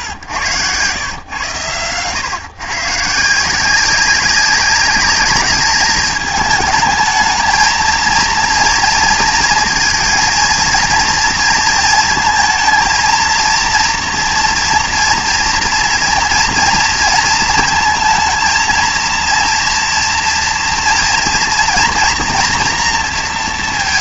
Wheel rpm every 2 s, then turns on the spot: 100, 140, 200, 220, 230, 230, 220, 240, 230, 230, 230, 230.
none